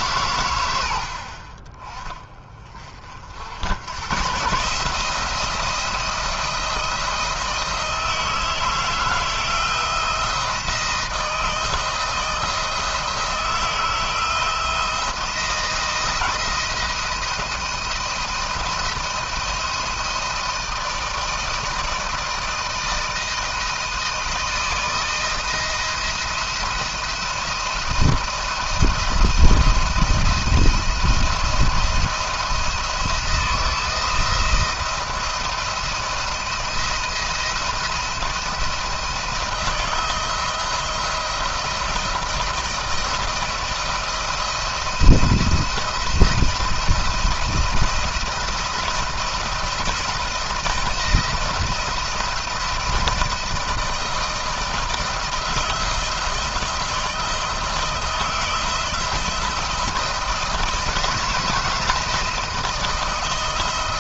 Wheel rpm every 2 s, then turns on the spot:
90, 40, 140, 170, 160, 170, 160, 170, 170, 170, 160, 160, 160, 170, 170, 170, 170, 170, 170, 170, 160, 170, 170, 170, 170, 170, 170, 160, 170, 170, 170, 170.
none